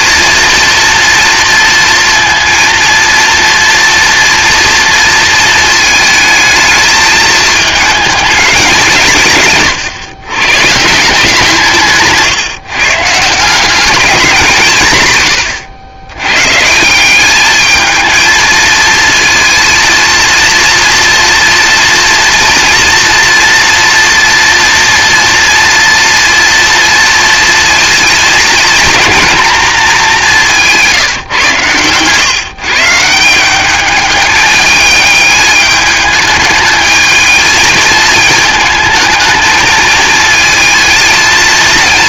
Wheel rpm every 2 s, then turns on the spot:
230, 230, 230, 220, 170, 160, 150, 130, 170, 230, 230, 230, 240, 230, 230, 160, 150, 210, 220, 220, 220.
30-32